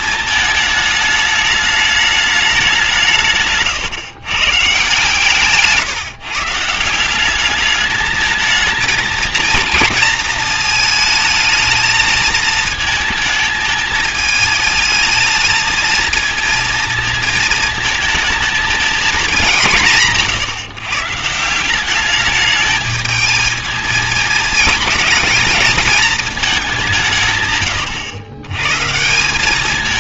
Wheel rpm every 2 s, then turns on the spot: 220, 200, 130, 160, 220, 220, 220, 220, 230, 220, 130, 210, 220, 210, 130.
none